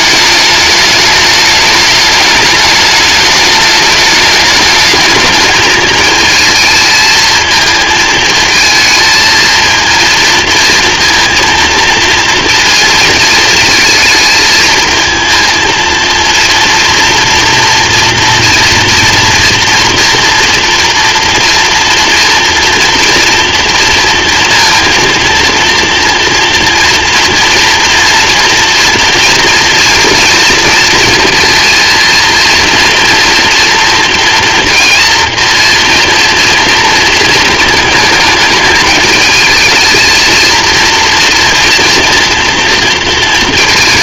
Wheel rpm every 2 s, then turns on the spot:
210, 210, 220, 220, 220, 230, 230, 220, 230, 240, 230, 230, 230, 230, 230, 230, 230, 230, 230, 220, 230, 230.
none